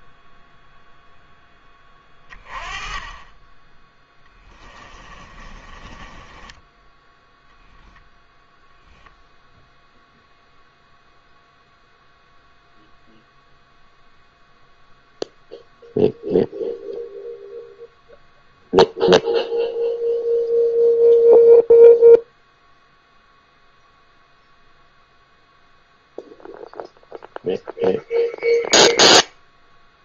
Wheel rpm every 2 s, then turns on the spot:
0, 20, 20, 10, 0, 0, 0, 0, 0, 0, 0, 0, 0, 0, 0.
4-8